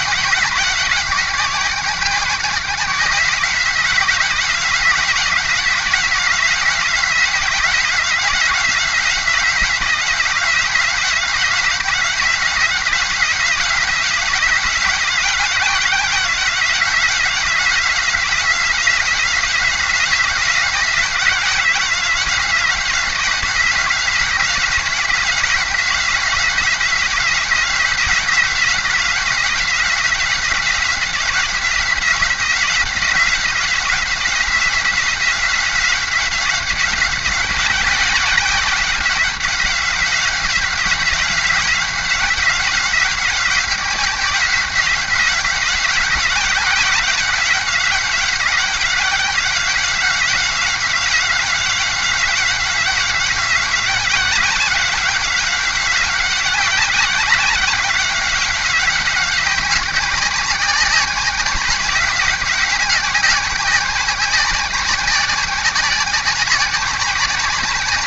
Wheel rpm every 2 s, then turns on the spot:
180, 180, 170, 180, 180, 180, 180, 180, 180, 180, 180, 180, 170, 180, 180, 180, 180, 180, 180, 190, 190, 190, 180, 190, 180, 190, 180, 190, 190, 190, 190, 190, 180, 190.
none